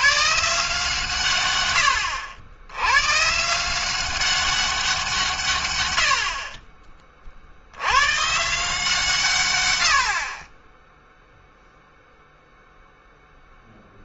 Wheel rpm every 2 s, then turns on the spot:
150, 110, 180, 30, 150, 20, 0.
none